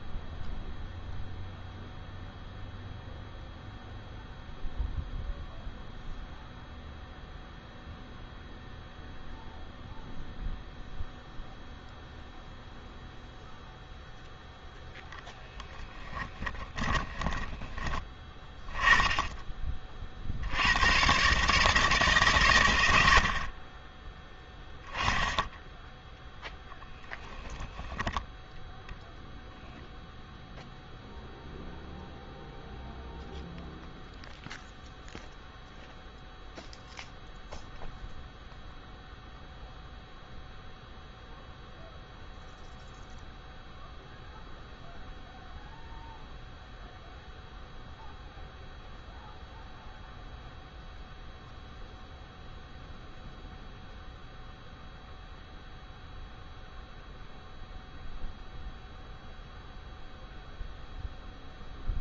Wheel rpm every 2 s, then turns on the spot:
0, 0, 0, 0, 0, 0, 0, 10, 10, 10, 110, 80, 10, 0, 0, 0, 0, 0, 0, 0, 0, 0, 0, 0, 0, 0, 0, 0, 0, 0, 0.
14-18